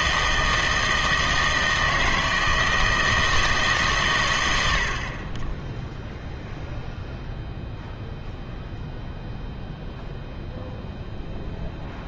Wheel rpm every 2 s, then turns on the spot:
160, 160, 100, 0, 0, 0.
none